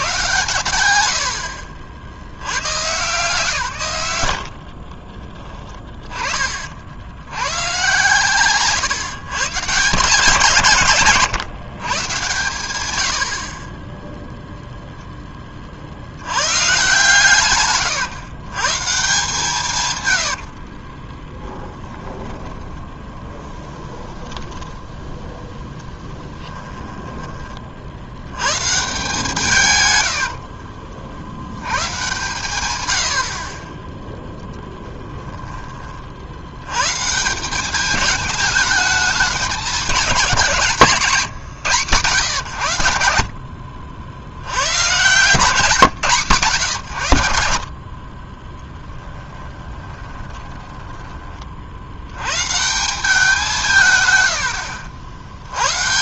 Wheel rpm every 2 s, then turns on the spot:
100, 110, 60, 70, 140, 140, 100, 0, 120, 140, 30, 20, 10, 20, 130, 40, 100, 20, 120, 210, 150, 100, 100, 110, 10, 10, 170, 70.
4-6 20-24 26-28 34-36 40-42 50-52